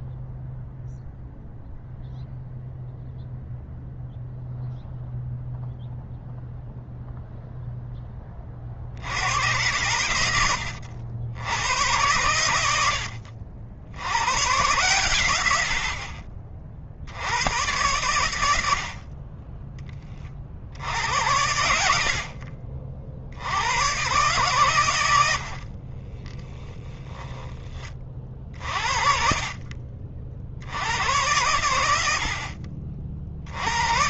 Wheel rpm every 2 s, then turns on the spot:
0, 0, 0, 0, 70, 80, 70, 110, 70, 40, 80, 60, 90, 20, 40, 90, 70.
24-26